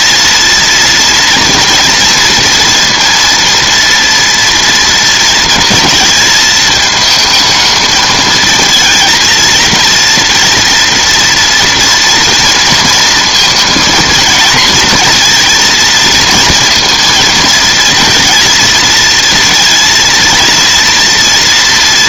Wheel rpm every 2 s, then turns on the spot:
230, 230, 230, 220, 220, 230, 230, 230, 230, 230, 230.
none